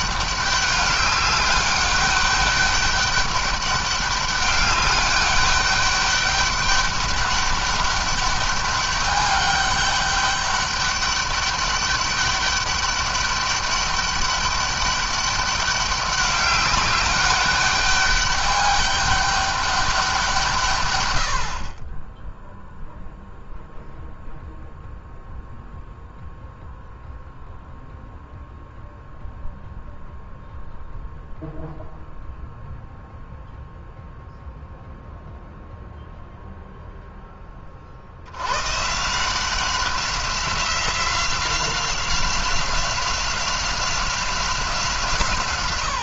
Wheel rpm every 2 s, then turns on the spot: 200, 200, 200, 200, 200, 200, 200, 200, 200, 200, 130, 0, 0, 0, 0, 0, 0, 0, 0, 130, 180, 190, 160.
none